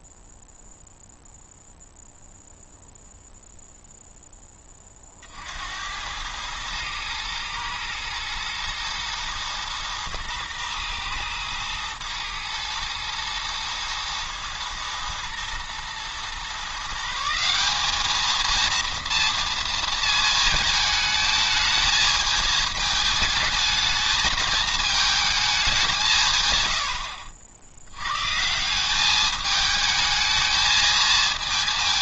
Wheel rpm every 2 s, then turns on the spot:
0, 0, 20, 110, 120, 120, 120, 110, 150, 230, 220, 220, 220, 80, 190, 220.
none